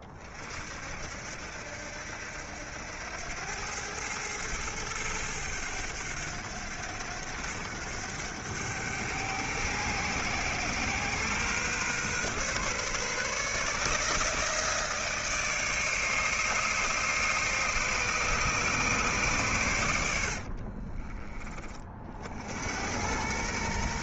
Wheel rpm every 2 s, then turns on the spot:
60, 90, 110, 100, 110, 130, 140, 160, 150, 140, 40, 90.
20-22